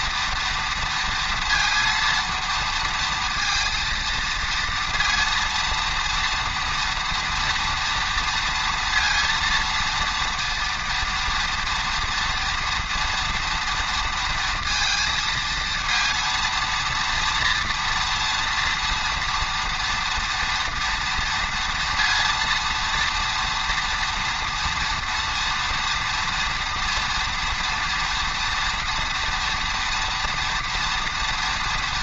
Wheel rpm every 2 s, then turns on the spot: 230, 230, 230, 230, 230, 230, 240, 230, 230, 230, 230, 230, 230, 230, 230, 230.
none